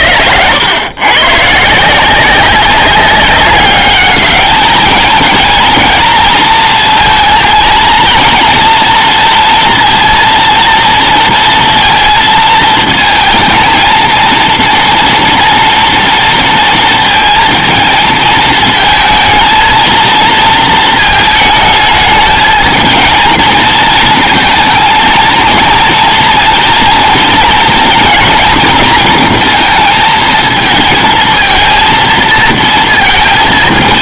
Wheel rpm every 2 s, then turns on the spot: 110, 190, 210, 230, 230, 230, 230, 230, 230, 220, 230, 220, 230, 230, 240, 220, 230.
none